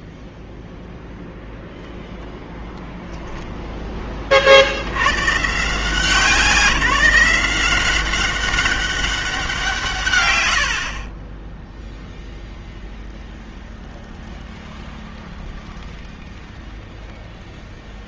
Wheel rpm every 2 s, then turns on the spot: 0, 0, 50, 180, 190, 50, 0, 0, 0.
10-12